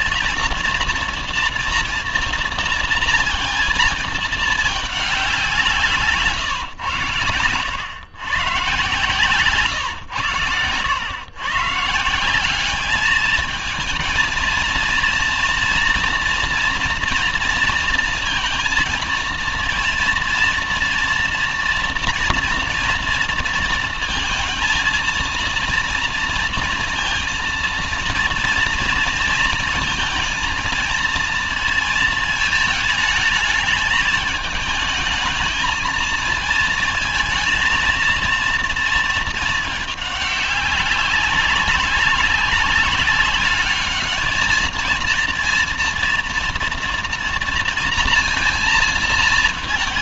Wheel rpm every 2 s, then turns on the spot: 230, 230, 220, 120, 130, 120, 190, 230, 240, 230, 230, 230, 220, 230, 230, 230, 220, 220, 220, 230, 200, 200, 210, 230, 230.
10-12